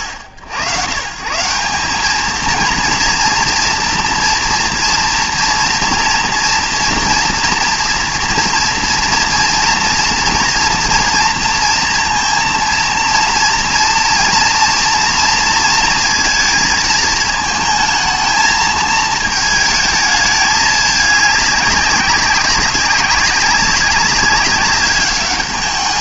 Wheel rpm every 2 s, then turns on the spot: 120, 230, 240, 240, 230, 230, 230, 230, 220, 220, 210, 190, 190.
none